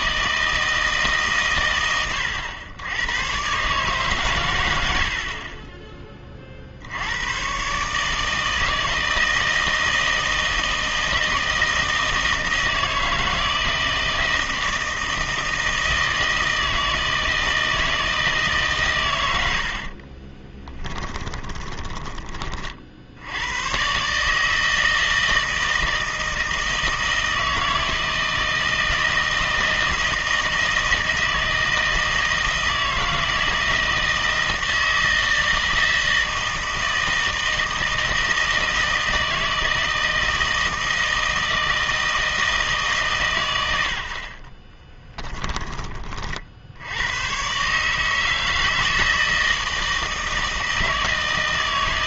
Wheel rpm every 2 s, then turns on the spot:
160, 90, 100, 50, 160, 160, 160, 160, 160, 140, 20, 40, 160, 160, 160, 160, 160, 160, 160, 160, 160, 160, 30, 60, 160, 160.
20-22 44-46